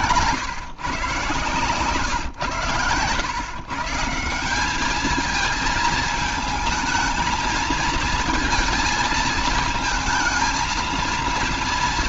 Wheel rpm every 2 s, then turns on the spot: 130, 120, 210, 230, 220, 220.
none